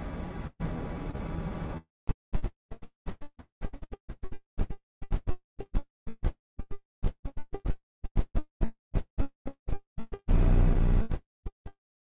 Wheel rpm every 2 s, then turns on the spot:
0, 0, 0, 0, 0, 0.
none